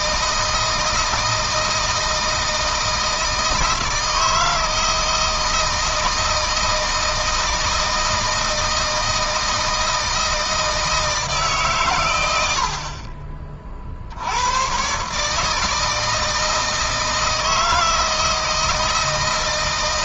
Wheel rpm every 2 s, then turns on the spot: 160, 160, 160, 160, 160, 160, 50, 120, 160, 160.
none